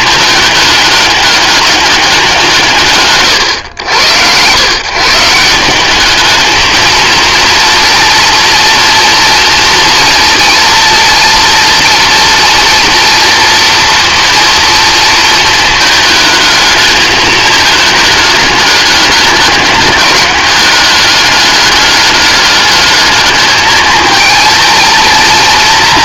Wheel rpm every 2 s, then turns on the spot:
200, 140, 150, 220, 230, 230, 230, 230, 210, 200, 200, 210, 230.
none